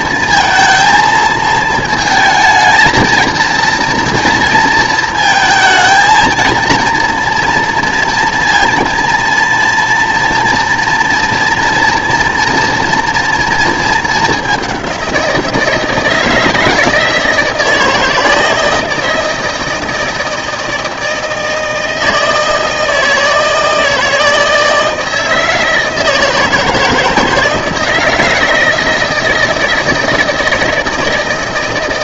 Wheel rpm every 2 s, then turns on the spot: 230, 220, 230, 230, 230, 230, 230, 200, 160, 160, 160, 160, 160, 160, 160, 160.
none